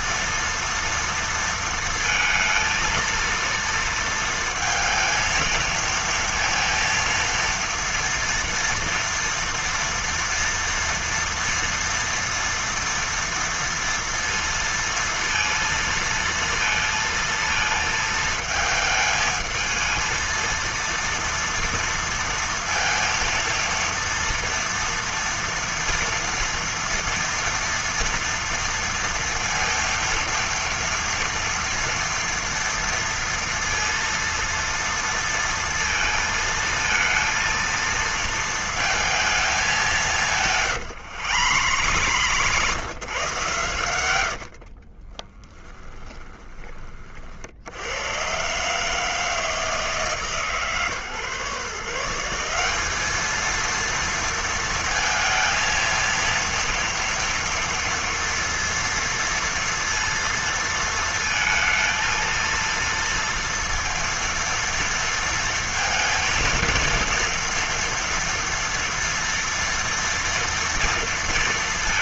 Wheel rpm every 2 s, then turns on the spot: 230, 230, 230, 230, 230, 230, 230, 230, 230, 220, 230, 230, 230, 230, 230, 230, 230, 230, 220, 220, 150, 130, 40, 30, 140, 150, 200, 230, 230, 230, 230, 230, 230, 230, 230, 230.
40-42 44-46